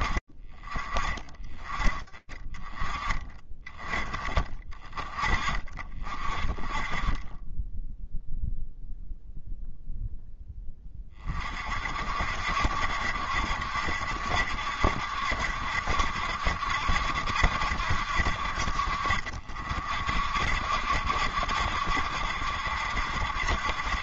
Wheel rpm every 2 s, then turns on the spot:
20, 30, 10, 0, 40, 70, 70, 70, 50, 70, 70, 40.
none